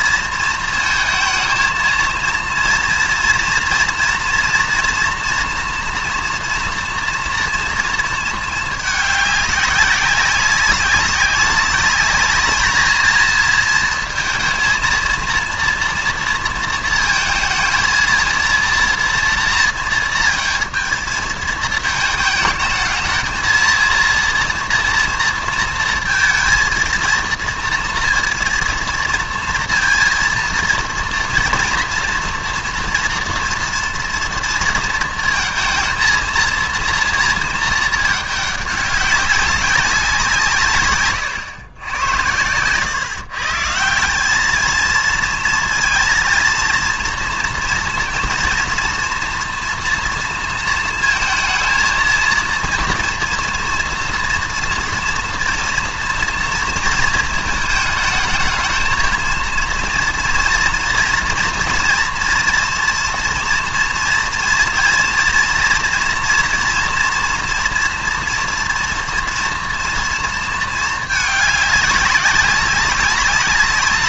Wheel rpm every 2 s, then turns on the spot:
230, 230, 230, 230, 210, 190, 220, 230, 230, 230, 220, 220, 230, 230, 230, 230, 230, 230, 230, 200, 150, 110, 220, 230, 230, 230, 230, 230, 230, 220, 230, 240, 230, 230, 230, 220, 190.
none